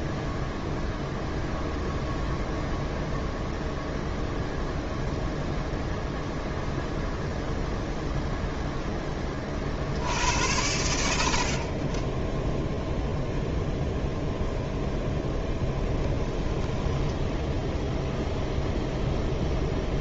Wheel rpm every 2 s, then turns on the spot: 0, 0, 0, 0, 0, 90, 10, 0, 10, 0.
16-18